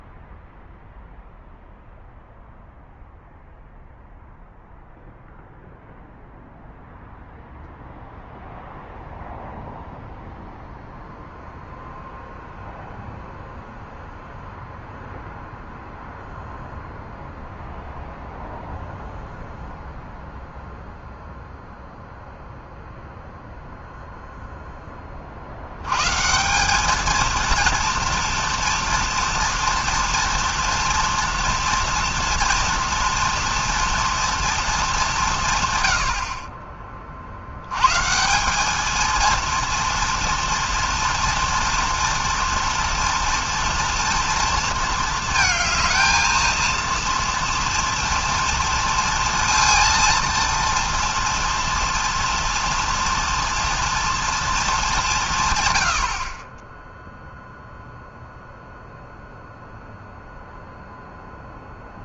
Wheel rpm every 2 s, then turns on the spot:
0, 0, 0, 0, 0, 0, 0, 0, 0, 0, 0, 0, 10, 200, 230, 230, 230, 210, 30, 220, 230, 230, 220, 230, 230, 230, 230, 210, 10, 0, 0.
none